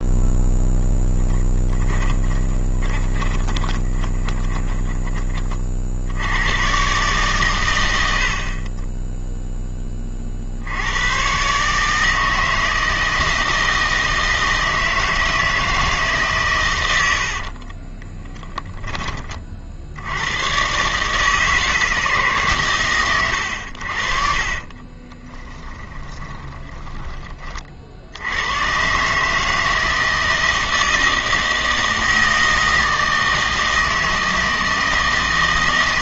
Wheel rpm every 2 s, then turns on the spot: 0, 20, 20, 110, 40, 70, 160, 160, 120, 10, 120, 140, 40, 20, 100, 160, 160, 160.
2-6 18-20 24-28